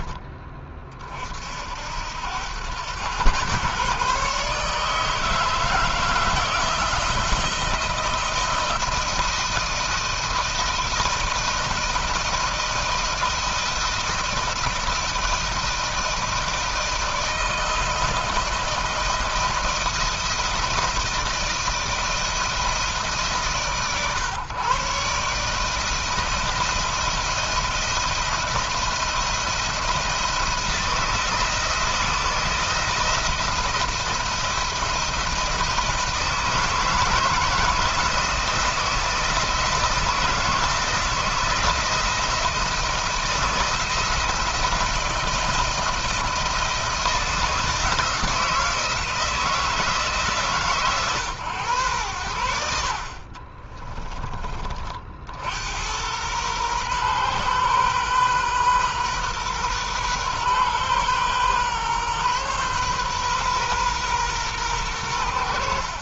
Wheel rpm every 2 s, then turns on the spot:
40, 110, 160, 170, 160, 160, 170, 170, 160, 160, 160, 150, 140, 160, 170, 160, 170, 170, 160, 160, 160, 170, 170, 170, 160, 120, 60, 50, 120, 130, 130, 130, 90.
52-54